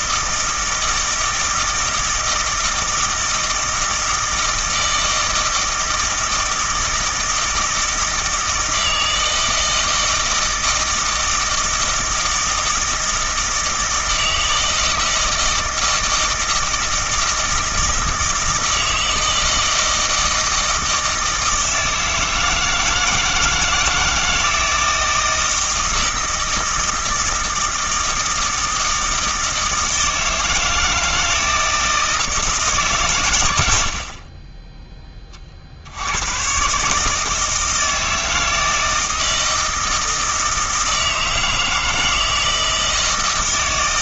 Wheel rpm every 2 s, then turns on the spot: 160, 160, 160, 160, 160, 160, 160, 160, 160, 160, 160, 160, 160, 160, 160, 160, 150, 10, 140, 160, 160, 160.
none